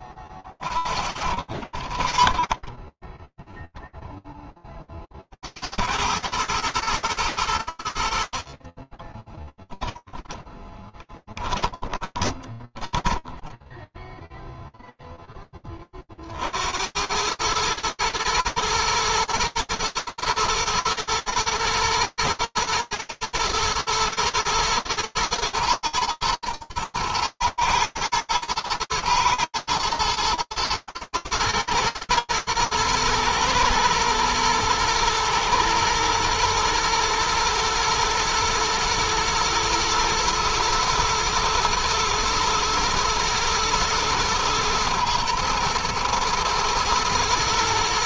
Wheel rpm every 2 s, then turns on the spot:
50, 10, 70, 100, 10, 10, 10, 10, 100, 120, 110, 120, 120, 120, 110, 110, 110, 110, 110, 120, 110, 120, 120, 120.
8-14